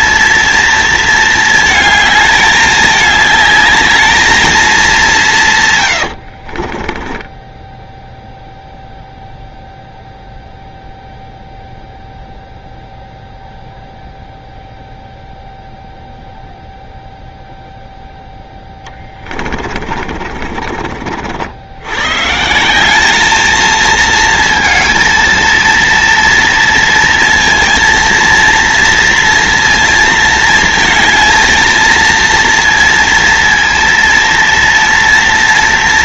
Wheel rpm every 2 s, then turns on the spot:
230, 210, 210, 50, 0, 0, 0, 0, 0, 10, 50, 160, 220, 230, 230, 220, 230, 230.
6-8 18-22